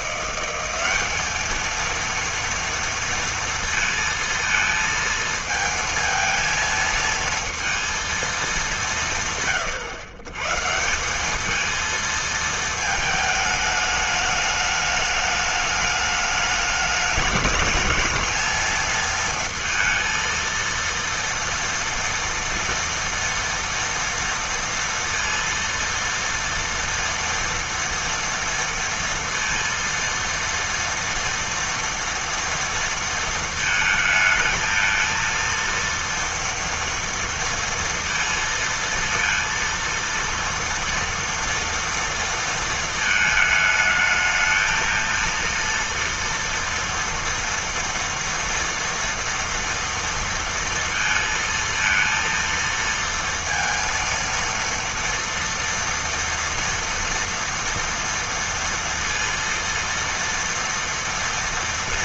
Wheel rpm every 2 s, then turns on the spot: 190, 230, 230, 230, 200, 140, 220, 210, 210, 220, 230, 240, 230, 230, 230, 230, 230, 220, 240, 230, 230, 230, 220, 230, 230, 230, 230, 230, 230, 230, 230.
none